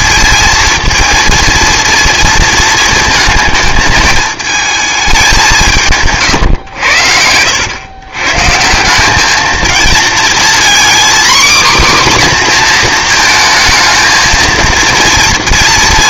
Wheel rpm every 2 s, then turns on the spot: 230, 230, 220, 110, 160, 240, 250, 230.
none